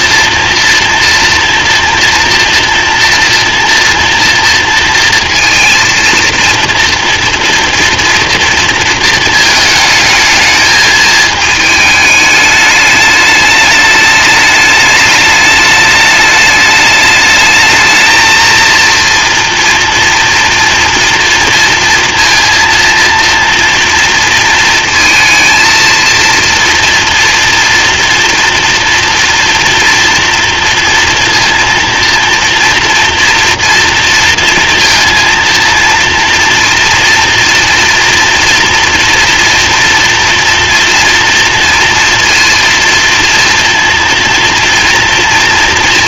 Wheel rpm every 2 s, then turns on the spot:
240, 230, 230, 230, 230, 220, 210, 210, 210, 230, 230, 230, 230, 230, 230, 230, 230, 230, 230, 230, 230, 230, 230.
none